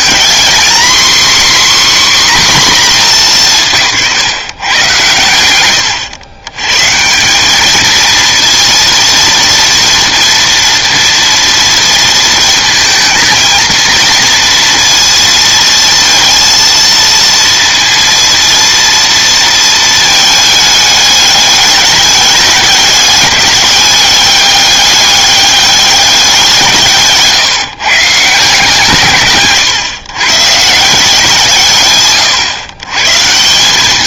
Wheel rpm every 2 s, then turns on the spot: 250, 250, 130, 120, 230, 230, 220, 230, 230, 230, 210, 200, 200, 170, 160, 150, 120.
none